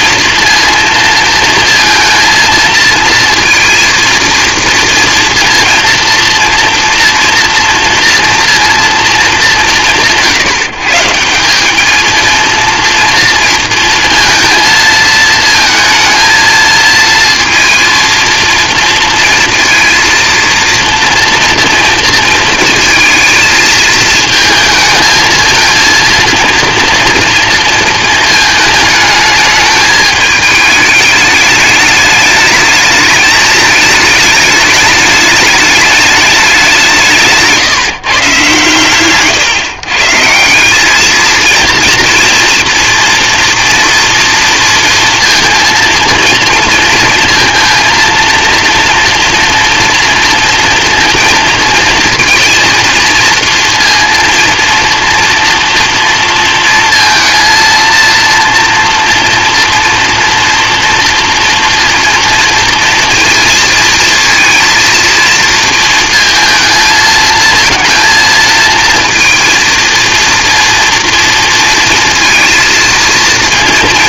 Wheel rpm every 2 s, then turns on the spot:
230, 230, 230, 230, 230, 160, 230, 230, 230, 230, 230, 220, 220, 230, 220, 210, 210, 210, 180, 130, 180, 230, 230, 230, 230, 230, 230, 230, 230, 230, 230, 230, 230, 230, 230, 230, 230.
none